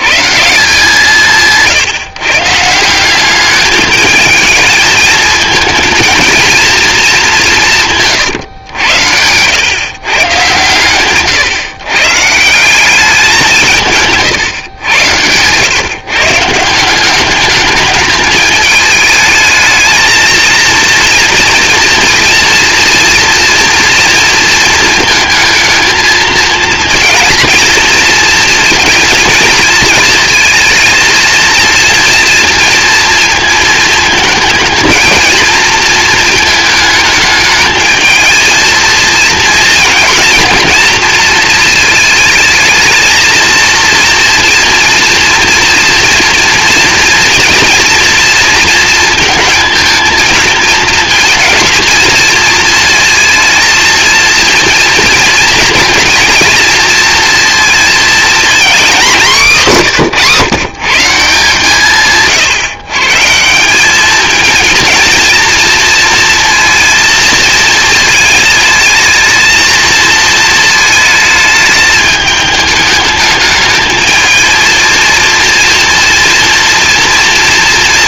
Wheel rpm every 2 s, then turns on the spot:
170, 160, 220, 220, 120, 120, 180, 120, 170, 210, 220, 230, 220, 220, 230, 230, 230, 220, 220, 230, 230, 220, 230, 230, 230, 220, 220, 230, 230, 240, 160, 140, 220, 230, 210, 220, 210, 220, 230.
none